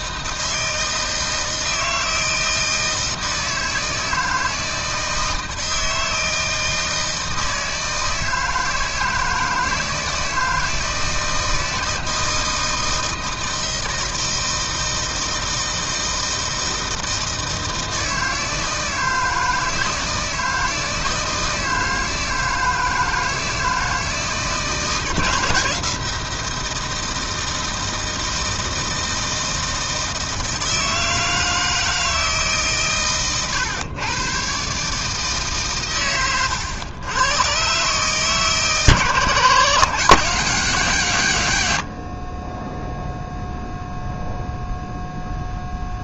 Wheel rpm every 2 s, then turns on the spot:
160, 160, 160, 160, 160, 160, 160, 160, 160, 160, 160, 160, 160, 160, 160, 160, 130, 140, 120, 140, 150, 0, 0.
none